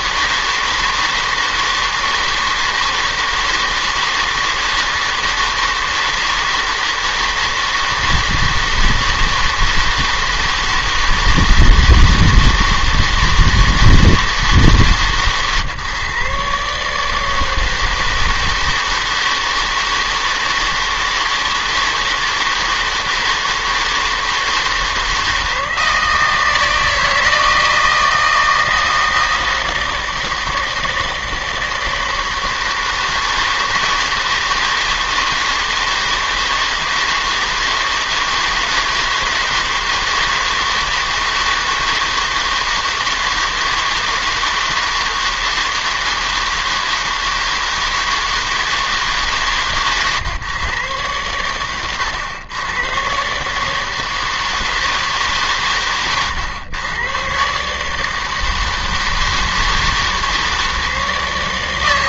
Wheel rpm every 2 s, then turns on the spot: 160, 160, 160, 160, 160, 160, 160, 150, 150, 160, 160, 160, 160, 160, 160, 160, 160, 160, 160, 160, 160, 160, 160, 160, 160, 120, 110, 160, 110, 160, 160.
none